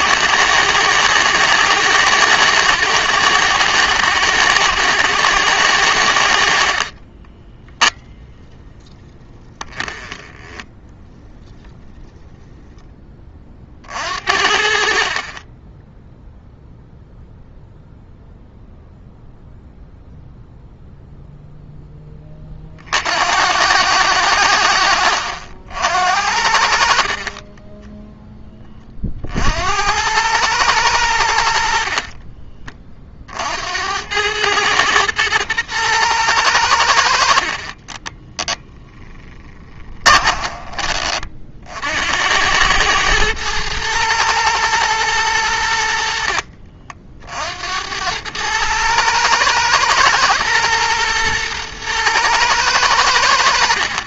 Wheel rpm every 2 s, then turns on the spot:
110, 110, 110, 50, 10, 10, 10, 50, 0, 0, 0, 50, 70, 50, 20, 100, 40, 110, 80, 10, 30, 100, 110, 50, 110, 120, 100.
6-8